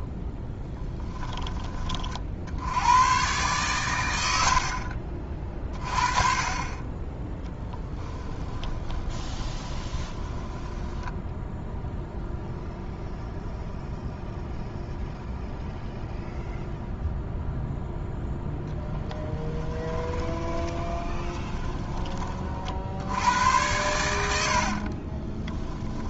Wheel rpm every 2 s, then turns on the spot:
10, 90, 60, 20, 20, 10, 0, 0, 0, 10, 20, 50, 50.
8-12 18-22 24-26